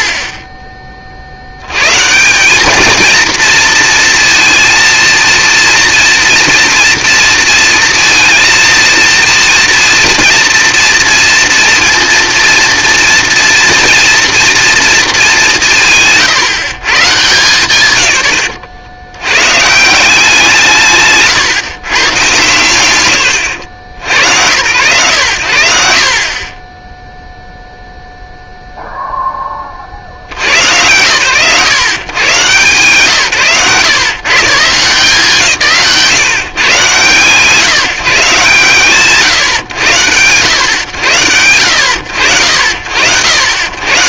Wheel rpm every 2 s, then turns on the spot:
40, 220, 230, 230, 230, 230, 230, 230, 150, 70, 160, 140, 100, 20, 0, 100, 150, 170, 110, 110, 110, 50.
none